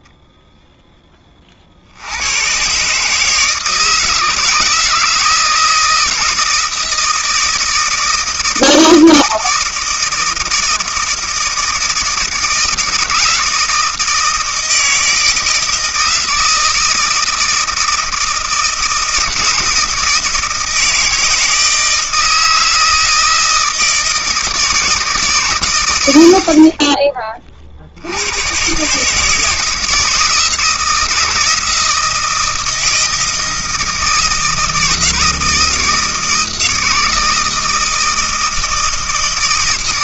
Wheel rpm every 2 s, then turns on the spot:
10, 140, 160, 160, 160, 160, 160, 160, 160, 160, 160, 160, 160, 40, 140, 160, 160, 160, 160, 160.
26-28